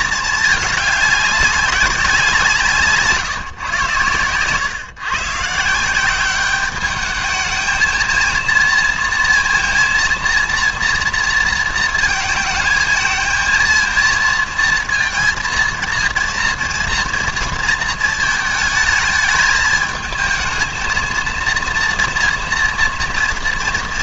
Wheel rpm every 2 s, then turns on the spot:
220, 170, 120, 200, 230, 230, 220, 230, 230, 220, 230, 230.
none